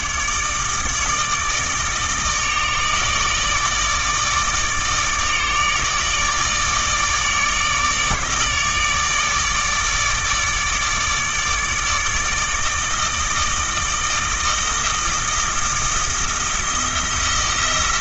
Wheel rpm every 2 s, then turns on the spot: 150, 150, 150, 150, 150, 150, 160, 160, 170.
none